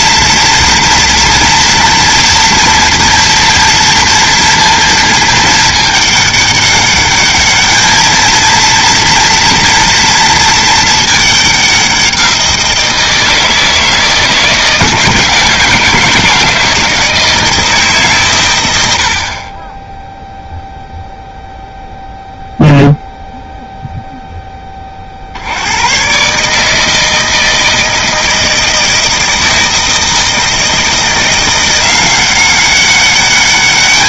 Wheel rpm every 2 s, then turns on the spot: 230, 230, 230, 200, 230, 220, 170, 160, 160, 110, 0, 0, 20, 150, 160, 160, 190.
none